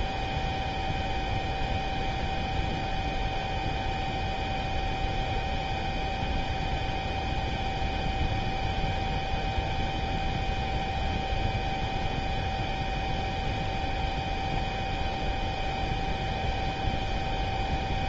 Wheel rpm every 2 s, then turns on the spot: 0, 0, 0, 0, 0, 0, 0, 0, 0.
none